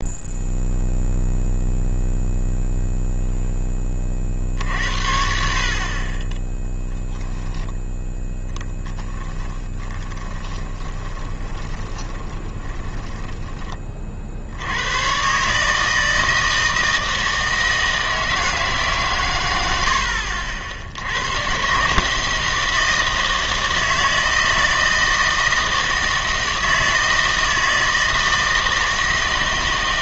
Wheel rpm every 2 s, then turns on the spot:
0, 0, 60, 10, 10, 20, 20, 70, 160, 160, 70, 160, 160, 160, 160.
10-14